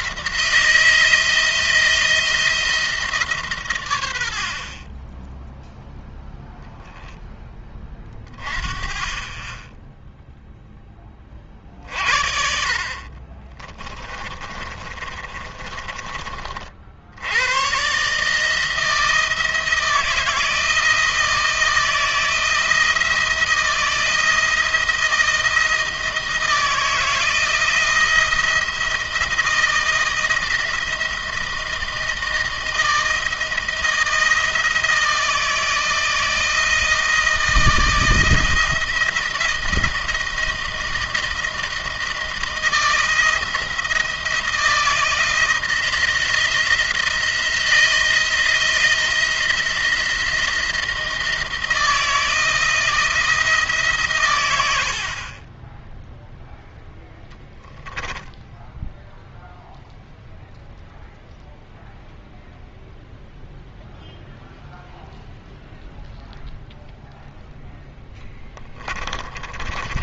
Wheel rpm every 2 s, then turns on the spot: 160, 160, 30, 0, 30, 20, 40, 30, 70, 160, 170, 170, 170, 160, 170, 170, 170, 160, 160, 160, 170, 170, 160, 170, 170, 170, 160, 80, 10, 0, 0, 0, 0, 0, 30.
12-16 68-70